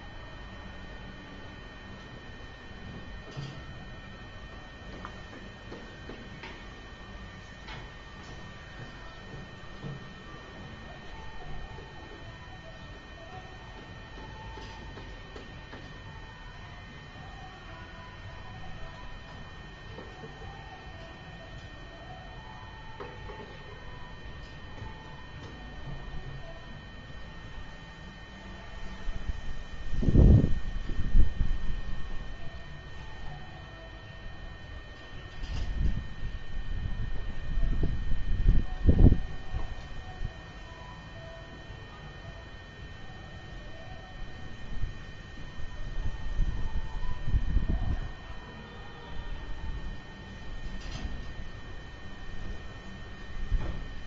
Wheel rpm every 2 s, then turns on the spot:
0, 0, 0, 0, 0, 0, 0, 0, 0, 0, 0, 0, 0, 0, 0, 0, 0, 0, 0, 0, 0, 0, 0, 0, 0, 0, 0.
none